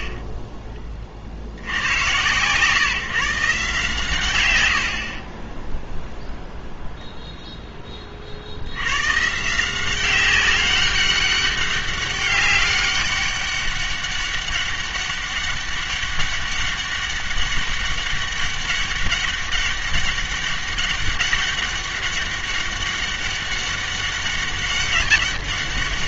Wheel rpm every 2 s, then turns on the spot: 30, 130, 110, 0, 70, 190, 200, 200, 200, 200, 200, 200, 200.
0-2